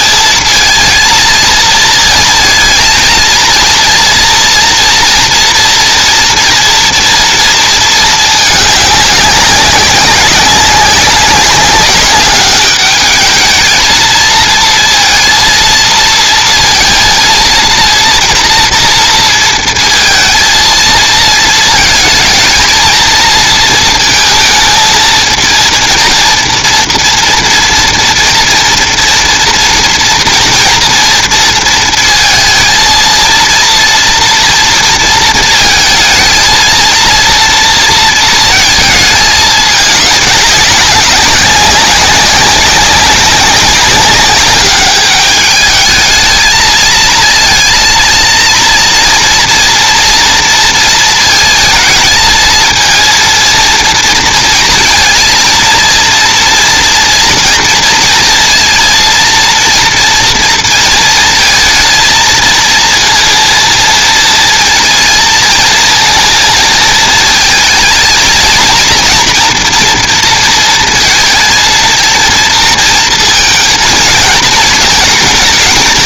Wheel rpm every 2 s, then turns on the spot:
230, 230, 240, 230, 200, 200, 210, 230, 230, 230, 230, 230, 220, 230, 230, 230, 230, 230, 230, 220, 200, 200, 210, 220, 230, 230, 230, 230, 230, 230, 230, 230, 220, 230, 230, 230, 230, 230.
none